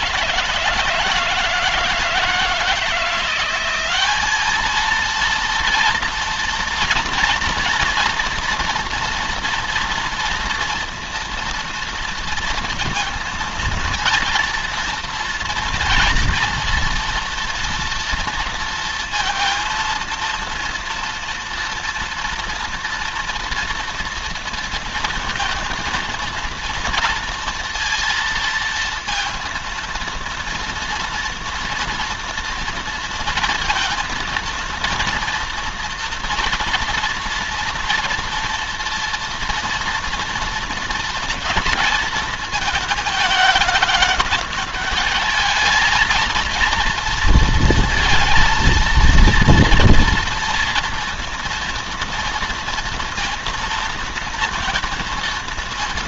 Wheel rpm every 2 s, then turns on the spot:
160, 170, 220, 230, 230, 230, 230, 230, 230, 230, 230, 230, 230, 230, 230, 230, 230, 230, 240, 230, 230, 220, 210, 230, 230, 230, 230, 230.
none